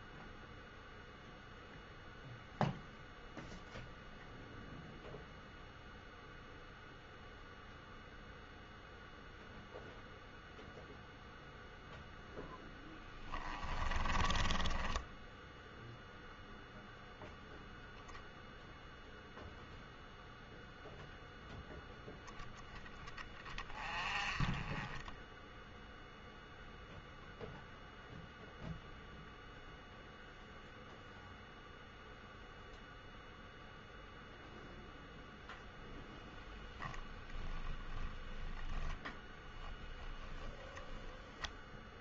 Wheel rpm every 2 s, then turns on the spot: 0, 0, 0, 0, 0, 0, 10, 10, 0, 0, 0, 10, 10, 0, 0, 0, 0, 0, 10, 10, 20.
14-16 38-42